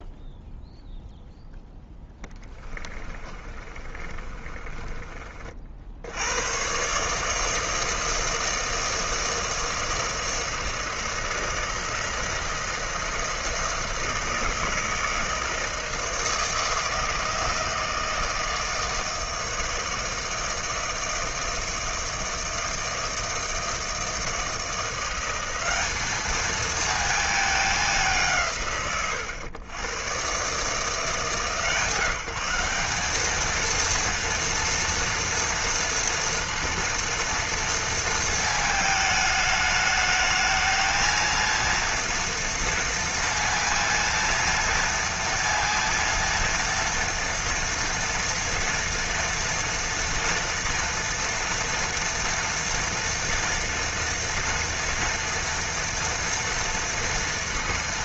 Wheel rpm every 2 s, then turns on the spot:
0, 20, 30, 110, 160, 160, 170, 160, 160, 160, 160, 160, 170, 220, 150, 140, 190, 230, 230, 220, 220, 230, 230, 230, 240, 230, 230, 230, 230.
2-6